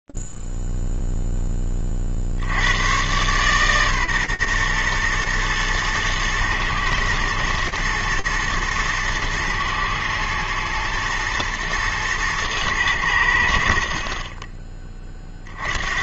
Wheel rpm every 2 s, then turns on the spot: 0, 20, 130, 110, 120, 110, 110, 40.
none